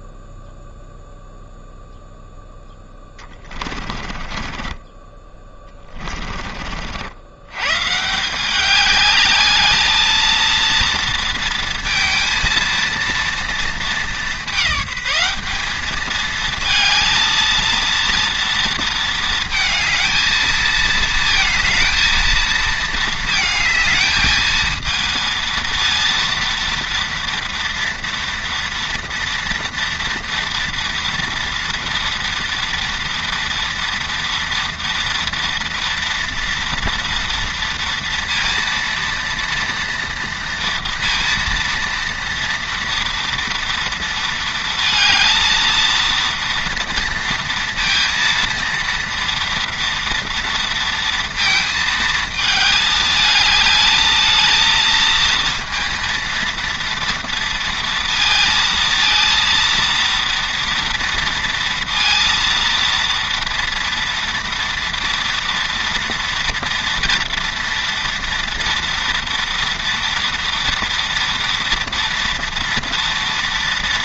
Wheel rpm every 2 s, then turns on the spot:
0, 10, 20, 60, 200, 230, 230, 200, 220, 230, 220, 220, 220, 230, 230, 230, 230, 240, 230, 230, 230, 230, 230, 230, 230, 230, 220, 220, 230, 230, 230, 230, 230, 230, 230, 230, 230.
2-6